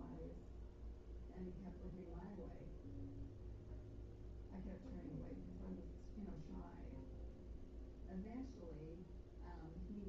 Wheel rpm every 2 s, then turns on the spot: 0, 0, 0, 0, 0.
none